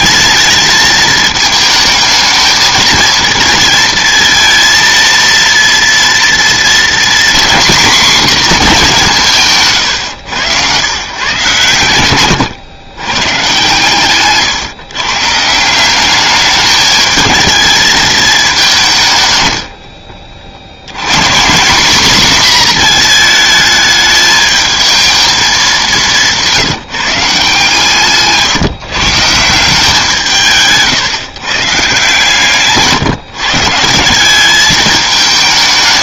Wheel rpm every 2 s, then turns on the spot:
220, 230, 230, 240, 220, 110, 110, 130, 210, 200, 60, 240, 210, 170, 150, 150, 140, 200.
none